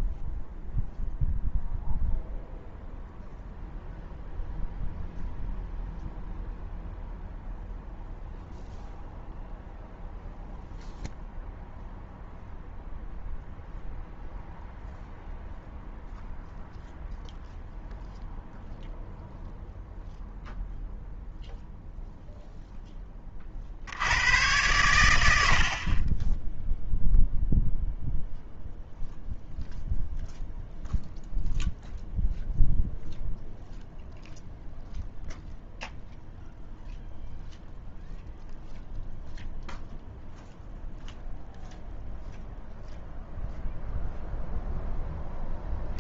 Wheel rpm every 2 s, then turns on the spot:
0, 0, 0, 0, 0, 0, 0, 0, 0, 0, 0, 0, 110, 0, 0, 0, 0, 0, 0, 0, 0, 0, 0.
none